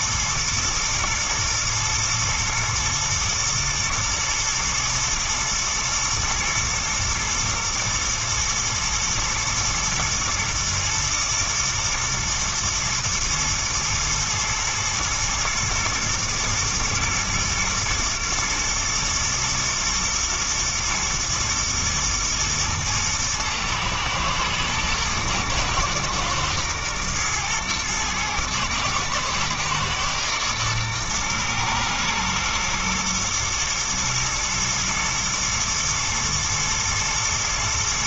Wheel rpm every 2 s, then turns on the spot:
110, 120, 120, 120, 110, 110, 110, 110, 120, 120, 110, 110, 110, 110, 110, 110, 120, 110, 110.
none